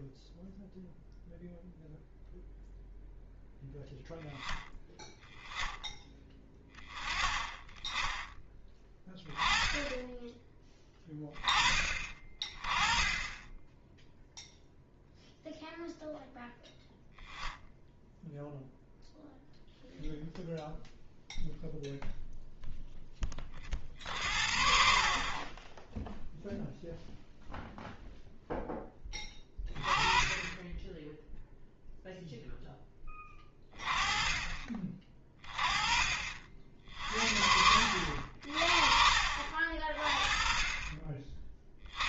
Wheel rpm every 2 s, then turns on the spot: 0, 0, 10, 20, 10, 10, 20, 0, 0, 0, 0, 0, 50, 0, 10, 10, 10, 30, 50, 40, 30.
none